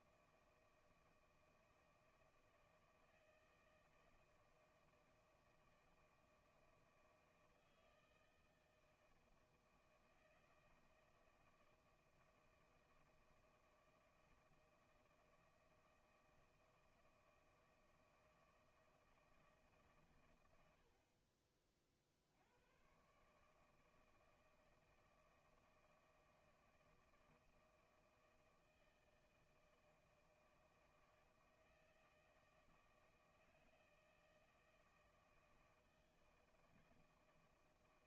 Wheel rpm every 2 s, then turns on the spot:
160, 160, 160, 160, 170, 160, 160, 160, 160, 160, 60, 120, 160, 160, 160, 160, 160, 160, 160.
none